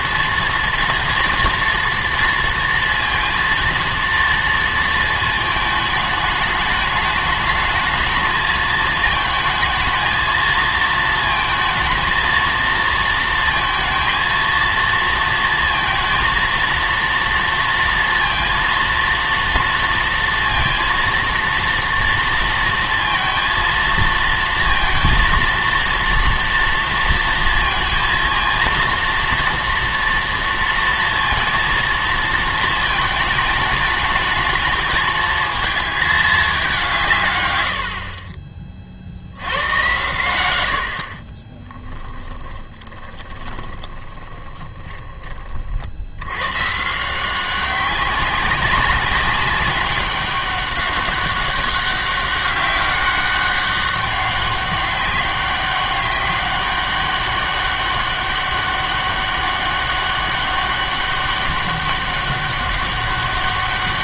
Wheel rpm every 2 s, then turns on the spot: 230, 230, 230, 210, 220, 230, 230, 230, 230, 230, 230, 230, 230, 230, 230, 230, 220, 220, 200, 30, 100, 20, 20, 130, 190, 200, 200, 200, 200, 200, 200, 200.
42-46